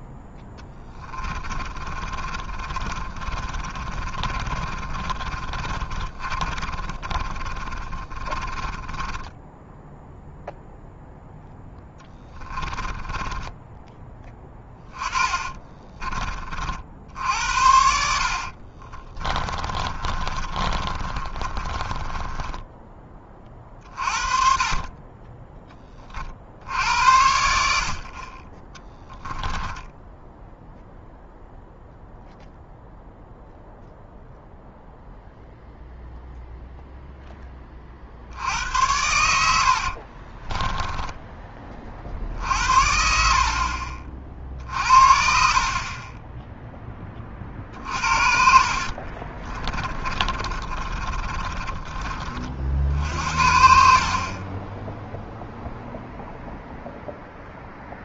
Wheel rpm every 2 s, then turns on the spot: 10, 30, 40, 30, 20, 0, 20, 20, 50, 30, 30, 10, 40, 60, 20, 0, 0, 0, 0, 90, 10, 60, 60, 10, 50, 30, 50, 20, 0.
0-10 12-16 18-22 28-30 40-42 48-52